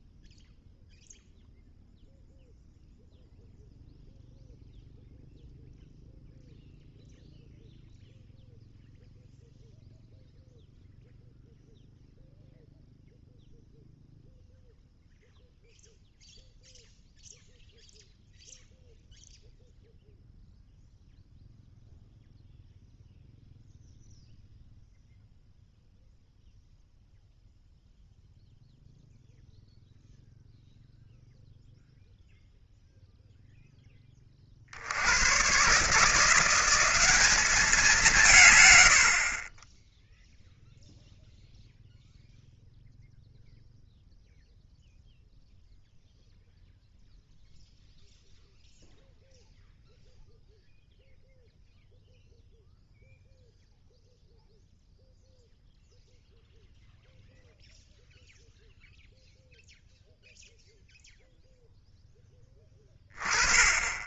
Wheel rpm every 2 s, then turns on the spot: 0, 0, 0, 0, 0, 0, 0, 0, 0, 0, 0, 0, 0, 0, 0, 0, 0, 70, 180, 100, 0, 0, 0, 0, 0, 0, 0, 0, 0, 0, 0, 20.
none